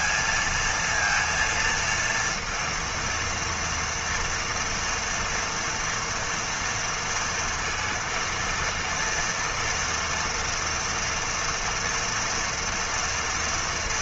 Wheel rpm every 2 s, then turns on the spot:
230, 230, 230, 230, 230, 240, 230.
none